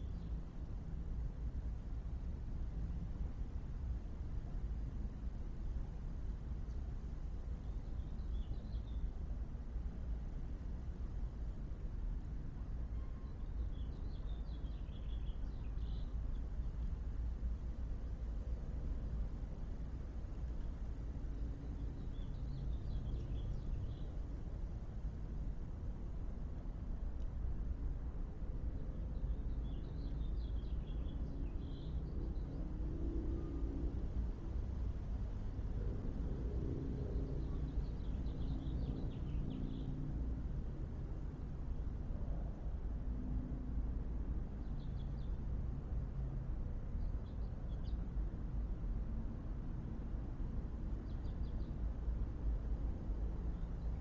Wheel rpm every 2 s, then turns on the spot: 0, 0, 0, 0, 0, 0, 0, 0, 0, 0, 0, 0, 0, 0, 0, 0, 0, 0, 0, 0, 0, 0, 0, 0, 0, 0, 0.
none